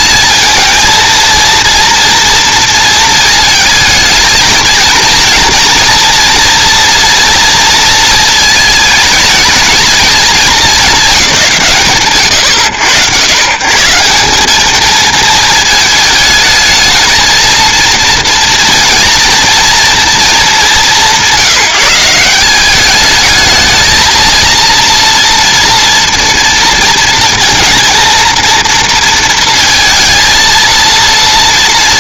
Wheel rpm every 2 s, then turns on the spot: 230, 230, 230, 230, 220, 220, 100, 210, 220, 230, 200, 180, 230, 230, 230, 230.
none